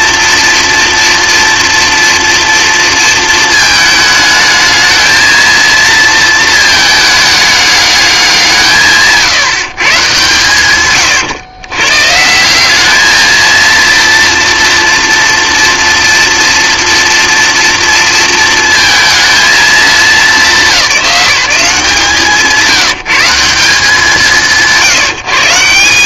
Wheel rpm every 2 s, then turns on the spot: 230, 230, 220, 220, 160, 130, 200, 230, 240, 230, 190, 170, 170.
none